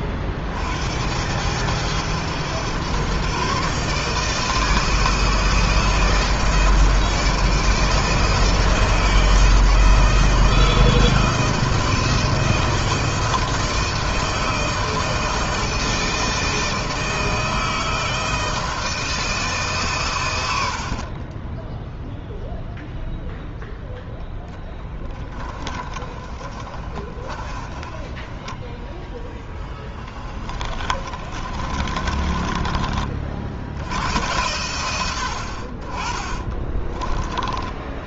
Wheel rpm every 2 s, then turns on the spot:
60, 120, 160, 160, 160, 160, 160, 160, 160, 160, 70, 0, 20, 30, 10, 20, 30, 100, 20.
20-22 24-32 36-38